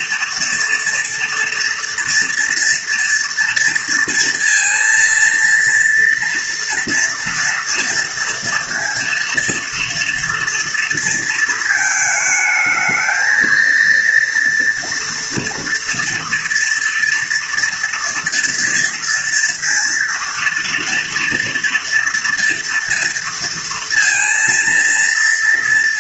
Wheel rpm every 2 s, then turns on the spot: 230, 230, 230, 230, 240, 230, 220, 240, 230, 230, 230, 230, 230.
none